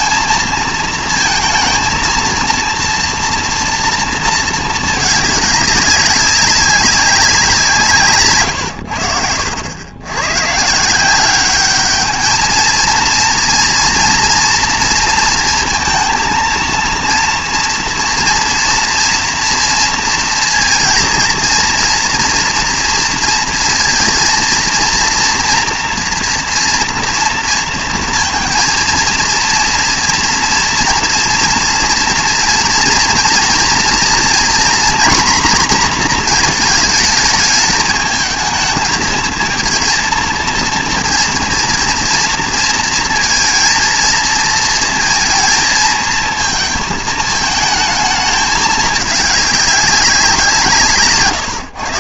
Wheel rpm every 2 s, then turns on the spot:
230, 230, 230, 200, 120, 140, 220, 240, 230, 230, 230, 230, 230, 240, 230, 230, 230, 230, 220, 220, 230, 230, 230, 220, 220, 170.
8-10